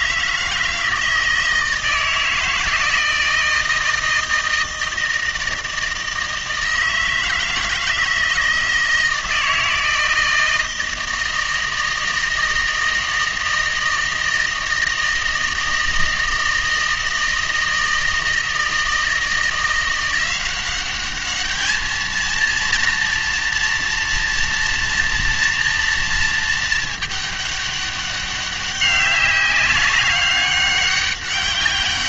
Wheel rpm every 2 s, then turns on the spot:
160, 160, 160, 160, 160, 160, 160, 160, 160, 160, 190, 230, 240, 220, 200, 200.
none